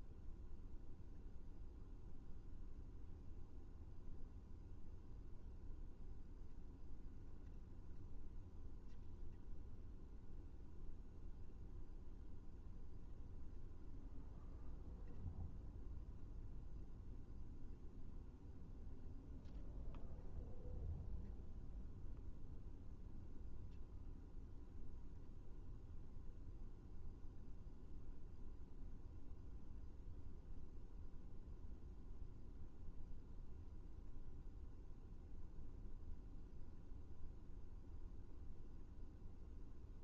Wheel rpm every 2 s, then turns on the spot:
0, 0, 0, 0, 0, 0, 0, 0, 0, 0, 0, 0, 0, 0, 0, 0, 0, 0, 0, 0.
none